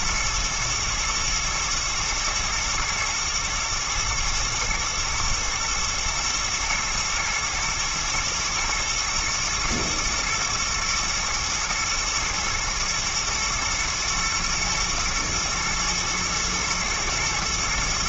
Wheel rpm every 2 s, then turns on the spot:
110, 110, 110, 120, 110, 120, 110, 110, 110.
none